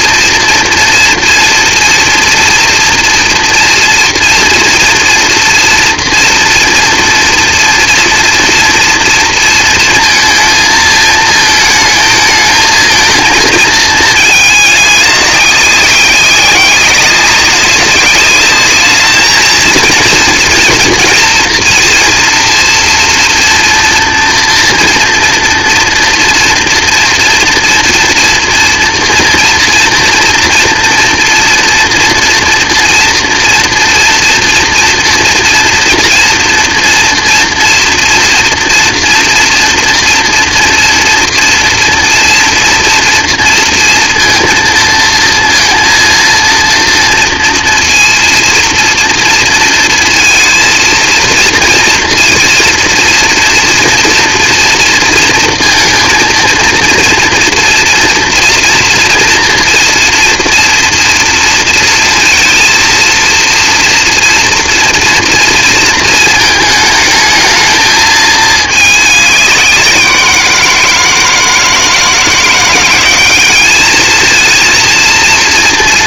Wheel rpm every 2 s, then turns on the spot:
230, 230, 240, 230, 240, 220, 220, 210, 190, 210, 230, 230, 240, 230, 230, 230, 240, 240, 230, 230, 230, 230, 230, 230, 230, 230, 230, 230, 230, 230, 230, 230, 230, 220, 210, 170, 170, 230.
none